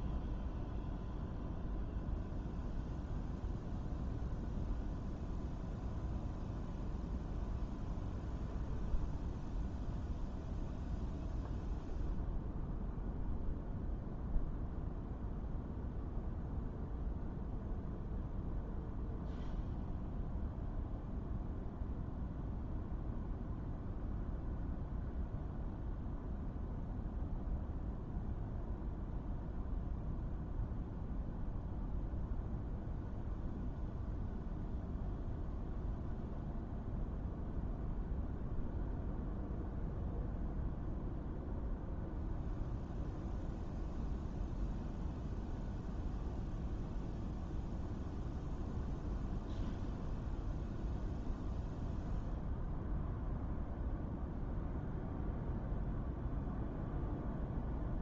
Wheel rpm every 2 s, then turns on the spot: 0, 0, 0, 0, 0, 0, 0, 0, 0, 0, 0, 0, 0, 0, 0, 0, 0, 0, 0, 0, 0, 0, 0, 0, 0, 0, 0, 0, 0.
none